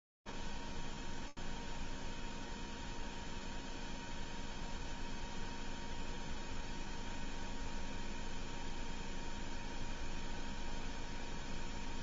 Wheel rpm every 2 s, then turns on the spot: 0, 0, 0, 0, 0, 0.
none